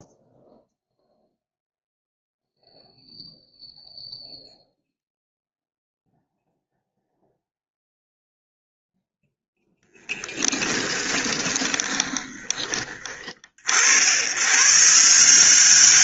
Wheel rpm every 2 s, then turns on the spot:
0, 0, 0, 0, 0, 10, 20, 140.
10-12